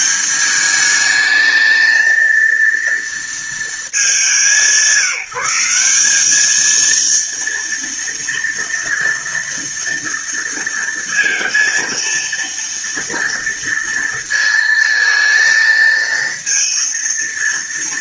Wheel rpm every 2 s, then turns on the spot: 210, 230, 180, 230, 230, 230, 230, 230, 230.
none